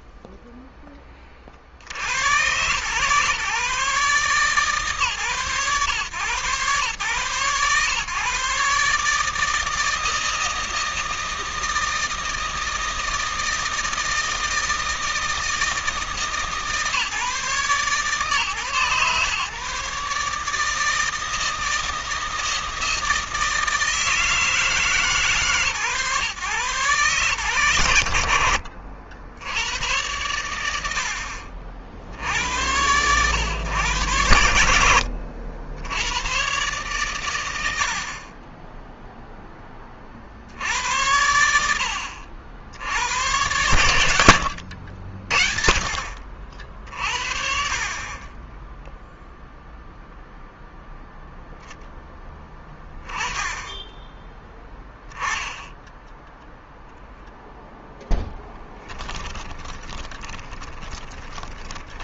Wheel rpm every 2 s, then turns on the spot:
20, 130, 140, 120, 150, 160, 160, 160, 150, 130, 160, 160, 150, 130, 60, 80, 100, 80, 120, 10, 90, 90, 60, 60, 0, 0, 10, 10, 0, 10, 20.
58-62